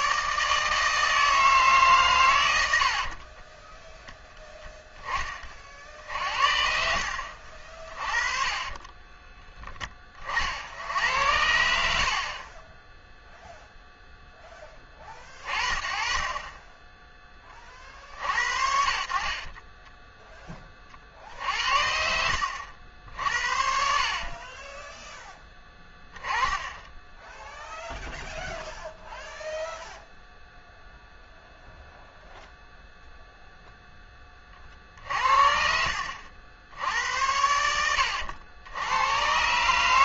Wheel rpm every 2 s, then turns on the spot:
150, 90, 10, 60, 20, 60, 30, 10, 20, 60, 30, 70, 30, 10, 0, 0, 0, 30, 70, 90.
8-10 22-26